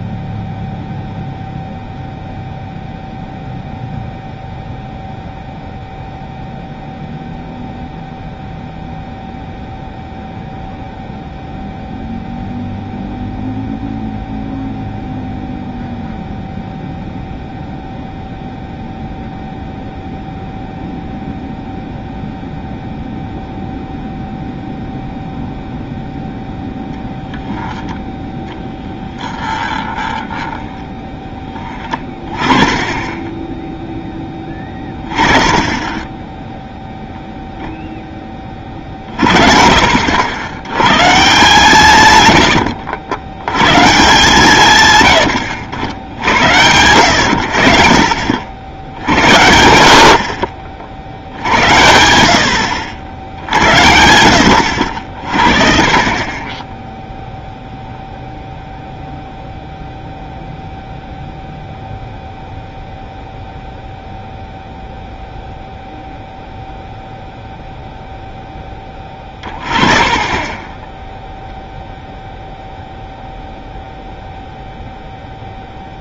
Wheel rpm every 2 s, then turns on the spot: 0, 0, 0, 0, 0, 0, 0, 0, 0, 0, 0, 0, 0, 0, 10, 10, 20, 20, 10, 30, 90, 80, 130, 100, 70, 50, 70, 90, 20, 0, 0, 0, 0, 0, 10, 20, 0, 0.
28-32 42-44 70-72